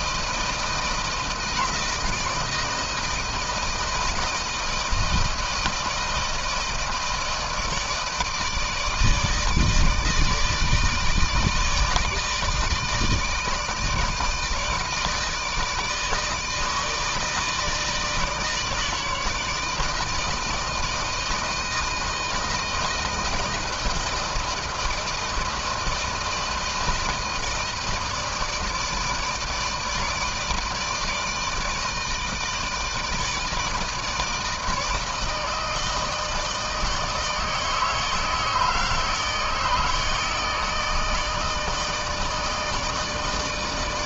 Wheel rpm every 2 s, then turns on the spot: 160, 160, 160, 160, 160, 160, 160, 160, 160, 150, 160, 160, 160, 160, 160, 160, 160, 160, 160, 160, 160, 150.
none